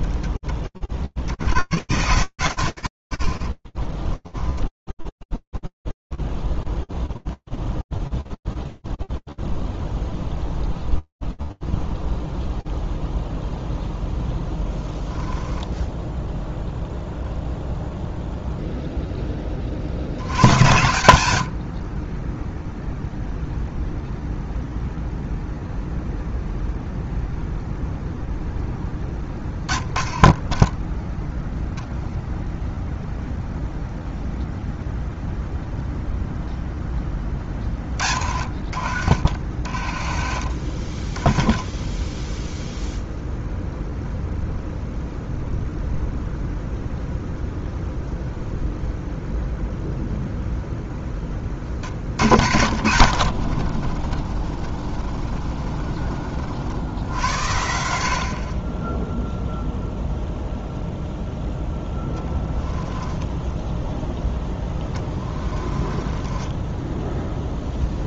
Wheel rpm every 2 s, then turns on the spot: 0, 10, 0, 0, 0, 0, 10, 30, 20, 0, 90, 10, 0, 0, 20, 10, 0, 0, 20, 50, 20, 0, 0, 0, 0, 30, 50, 30, 80, 0, 0, 10, 20, 0.
2-4 12-14 38-40 62-66